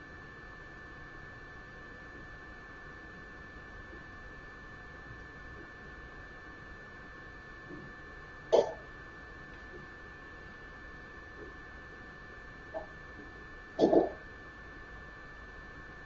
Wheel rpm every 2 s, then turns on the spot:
0, 0, 0, 0, 0, 0, 0, 0.
none